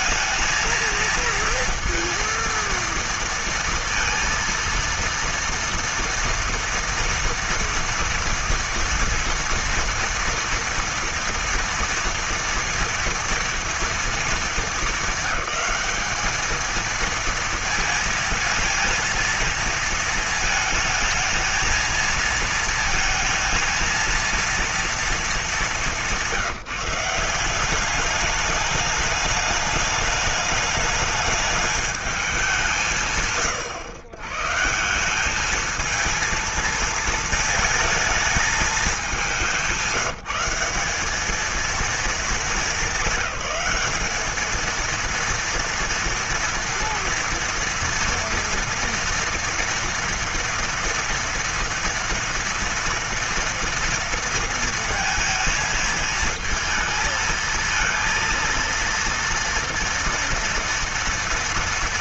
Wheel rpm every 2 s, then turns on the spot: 230, 230, 230, 230, 230, 230, 240, 220, 220, 220, 220, 230, 230, 190, 210, 210, 180, 150, 220, 220, 190, 220, 220, 230, 230, 230, 230, 230, 220, 230, 230.
none